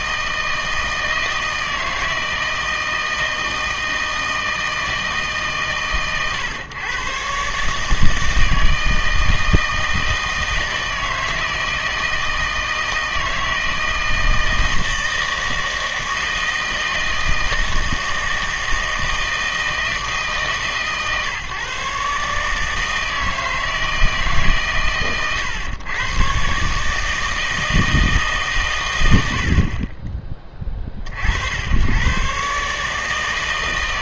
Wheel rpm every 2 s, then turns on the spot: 160, 160, 160, 120, 160, 160, 160, 160, 160, 160, 150, 150, 130, 140, 130, 30, 140.
none